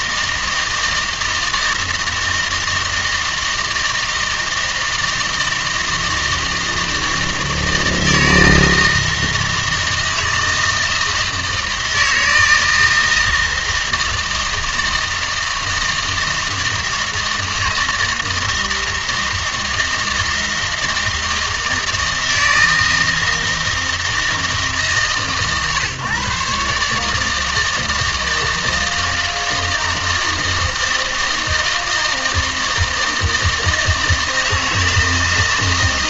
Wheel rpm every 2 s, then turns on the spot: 160, 160, 160, 160, 160, 160, 160, 160, 160, 160, 160, 160, 140, 140, 160, 160, 160, 160.
none